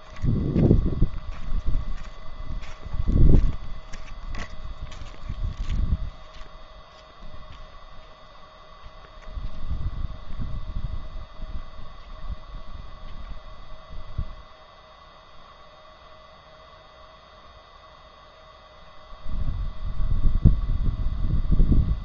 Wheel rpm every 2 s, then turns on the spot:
0, 0, 0, 0, 0, 0, 0, 0, 0, 0, 0.
none